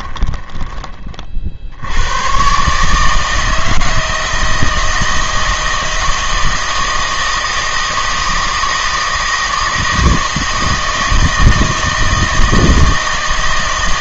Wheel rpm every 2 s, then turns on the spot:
20, 140, 160, 160, 160, 160, 160.
none